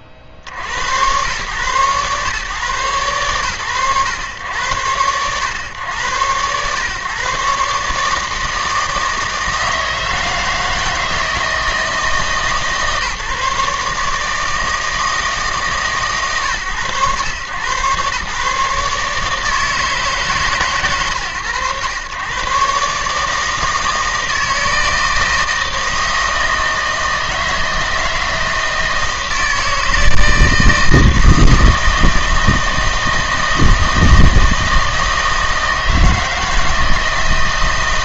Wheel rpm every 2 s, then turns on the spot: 30, 110, 110, 120, 160, 160, 150, 160, 120, 150, 120, 140, 160, 160, 160, 160, 160, 160, 160.
none